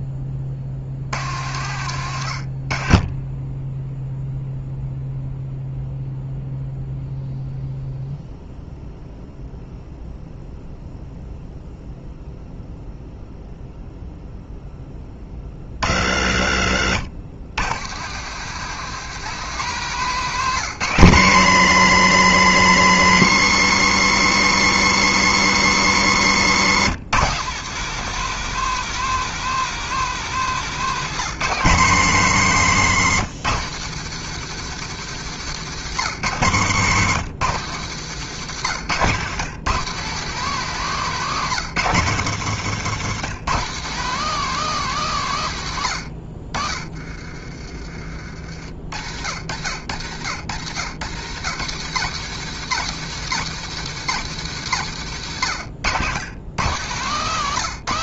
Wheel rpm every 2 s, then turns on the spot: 40, 40, 0, 0, 0, 0, 0, 10, 70, 160, 160, 140, 140, 150, 220, 190, 160, 140, 150, 140, 180, 150, 190, 30, 60, 80, 140, 120, 150.
46-48 54-56